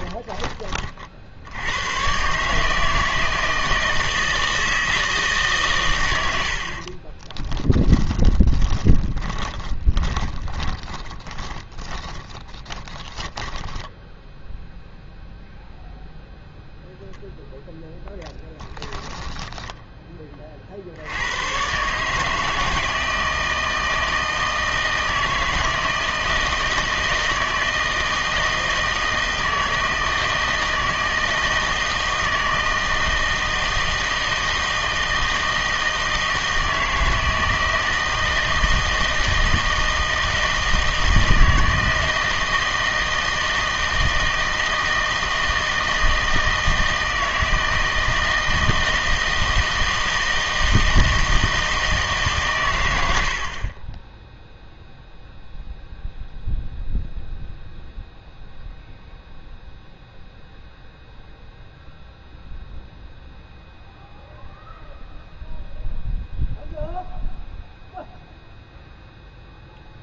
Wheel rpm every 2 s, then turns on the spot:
30, 150, 160, 70, 20, 20, 10, 0, 0, 10, 60, 160, 160, 160, 160, 160, 160, 160, 160, 160, 160, 160, 160, 160, 160, 160, 110, 0, 0, 0, 0, 0, 0, 0, 0.
8-14 18-20